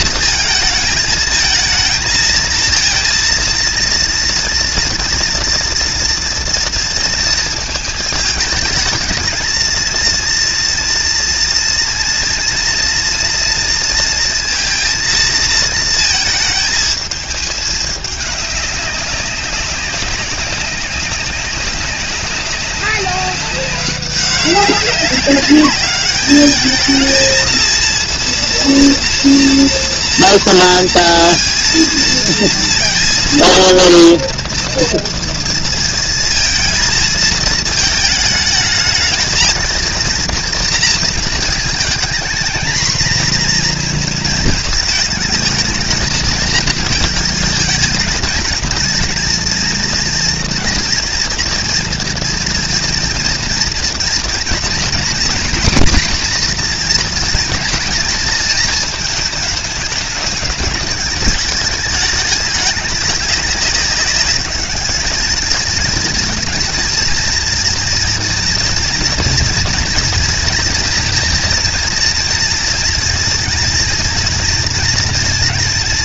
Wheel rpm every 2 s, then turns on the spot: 220, 230, 230, 230, 220, 230, 230, 230, 220, 200, 190, 190, 190, 210, 230, 230, 230, 230, 230, 220, 230, 230, 220, 220, 220, 230, 230, 240, 250, 220, 210, 200, 210, 220, 230, 230, 230, 230.
none